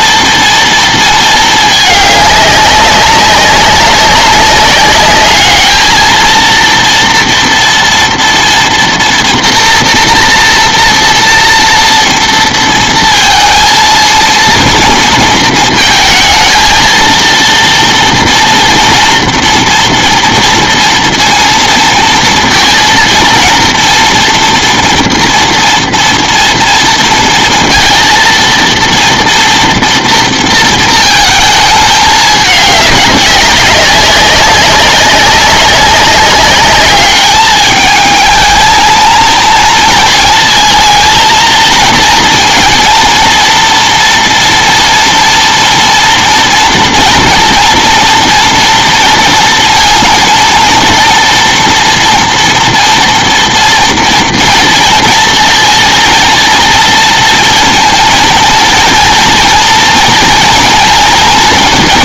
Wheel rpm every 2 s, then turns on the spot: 230, 200, 200, 230, 230, 230, 230, 230, 230, 230, 230, 230, 240, 230, 230, 230, 210, 190, 200, 220, 230, 230, 230, 240, 230, 230, 230, 230, 230, 230, 230.
none